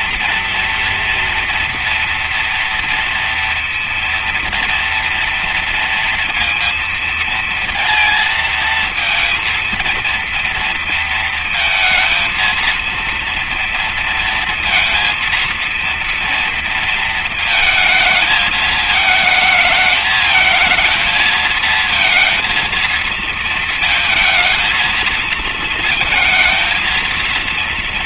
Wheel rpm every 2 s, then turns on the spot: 240, 230, 230, 230, 230, 230, 230, 230, 230, 220, 230, 230, 230, 230.
none